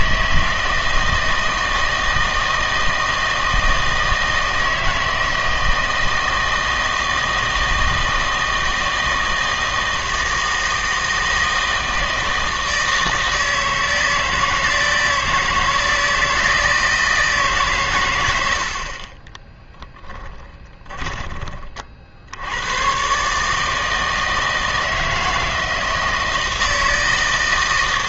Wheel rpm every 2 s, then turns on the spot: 160, 160, 160, 160, 160, 160, 160, 160, 160, 60, 20, 100, 160, 160.
20-22